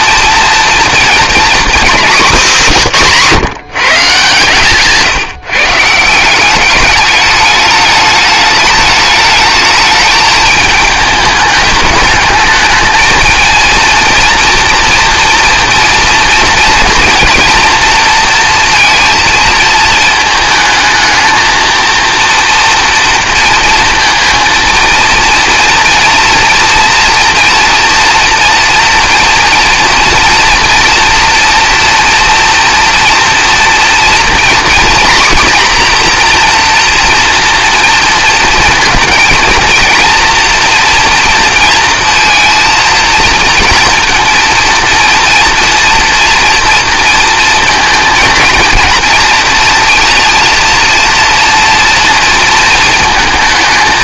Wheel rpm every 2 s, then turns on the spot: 230, 200, 150, 200, 210, 210, 220, 240, 230, 230, 220, 240, 230, 240, 230, 230, 240, 240, 240, 220, 240, 230, 230, 240, 230, 230, 230.
none